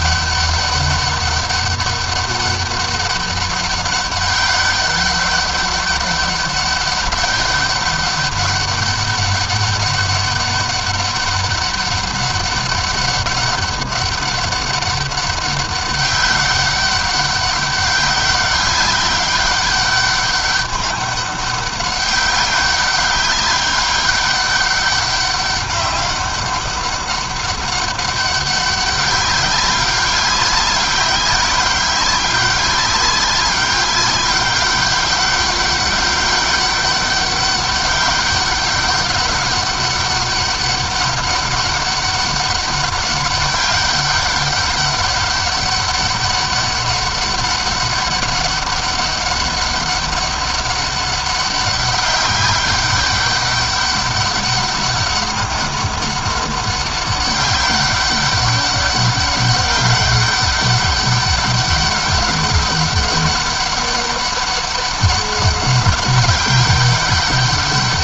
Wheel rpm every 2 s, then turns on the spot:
200, 200, 200, 200, 200, 200, 200, 200, 200, 190, 200, 200, 200, 200, 200, 190, 190, 200, 200, 200, 200, 200, 200, 200, 200, 200, 200, 200, 200, 200, 200, 200, 200, 200.
none